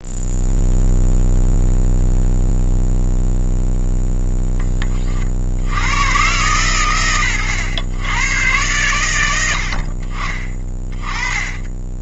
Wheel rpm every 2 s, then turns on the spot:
0, 0, 40, 110, 90, 20.
none